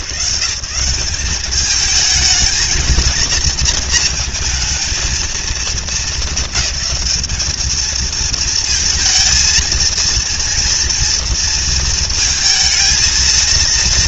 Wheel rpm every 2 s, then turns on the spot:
170, 220, 230, 220, 230, 230, 220.
none